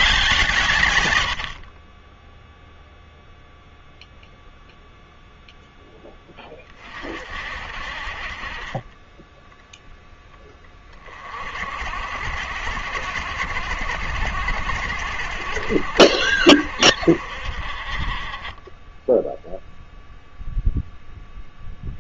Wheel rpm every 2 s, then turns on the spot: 120, 0, 0, 30, 20, 20, 60, 70, 50, 10, 0.
none